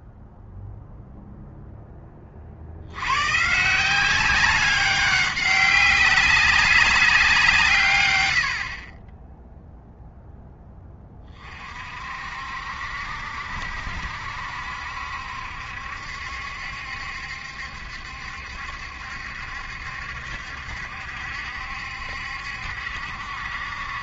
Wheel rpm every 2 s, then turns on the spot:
0, 70, 190, 190, 40, 10, 60, 70, 70, 70, 70, 70.
none